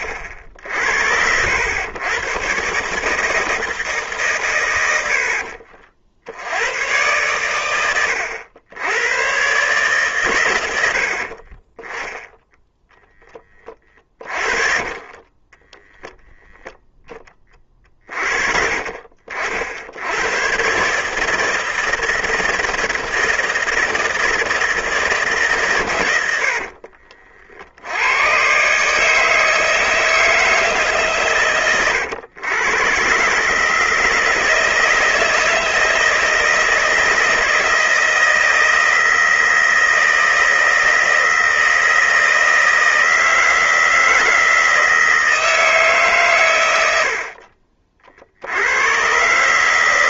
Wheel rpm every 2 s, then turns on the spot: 60, 130, 110, 100, 90, 90, 0, 30, 0, 50, 130, 160, 160, 60, 140, 160, 110, 160, 160, 160, 160, 160, 160, 100, 90.
14-16 26-28